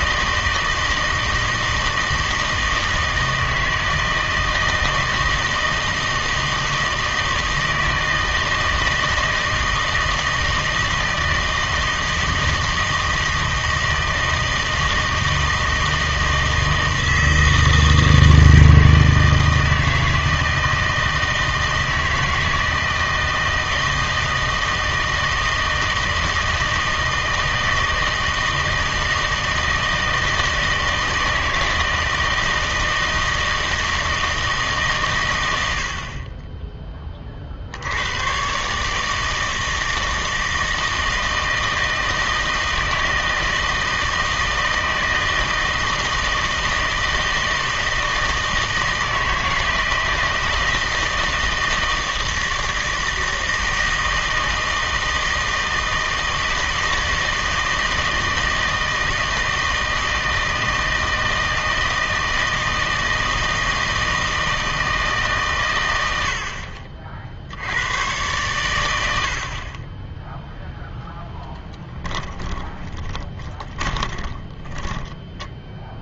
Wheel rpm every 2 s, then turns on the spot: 160, 160, 160, 160, 160, 160, 160, 160, 160, 160, 160, 160, 160, 160, 160, 160, 160, 150, 20, 140, 160, 160, 160, 160, 160, 160, 160, 160, 160, 160, 160, 160, 160, 50, 110, 0, 20, 20.
72-76